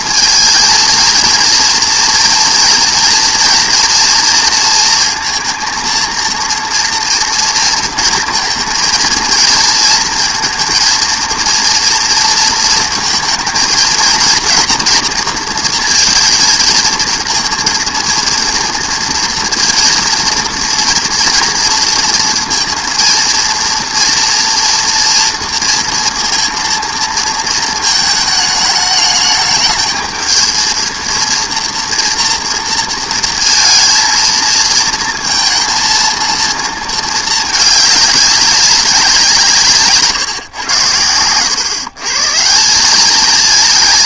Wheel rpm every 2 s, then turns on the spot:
220, 230, 230, 230, 230, 230, 220, 230, 230, 230, 230, 230, 230, 230, 210, 220, 230, 230, 220, 200, 120, 170.
none